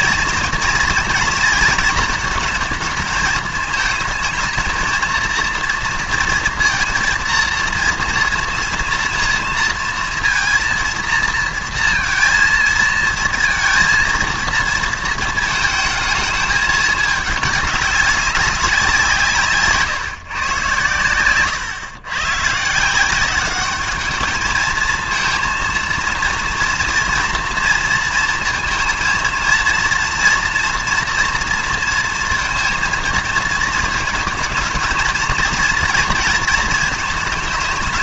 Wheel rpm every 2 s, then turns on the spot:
230, 220, 220, 230, 230, 230, 230, 230, 210, 190, 120, 150, 220, 240, 230, 230, 230, 220, 230.
none